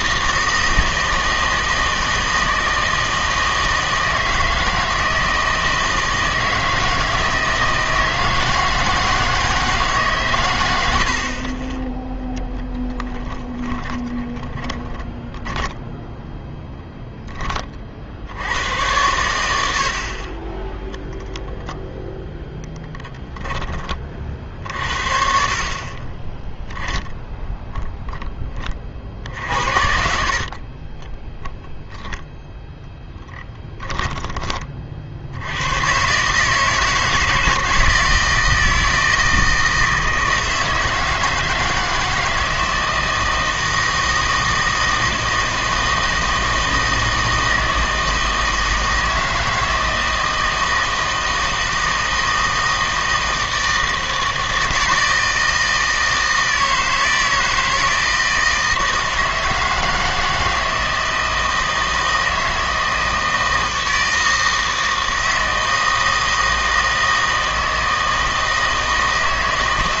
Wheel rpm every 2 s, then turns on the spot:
160, 160, 160, 160, 160, 90, 10, 10, 0, 80, 20, 20, 60, 10, 40, 30, 0, 30, 160, 160, 160, 160, 160, 160, 160, 160, 160, 160, 160, 160, 160, 160, 160, 160, 160.
12-16 22-24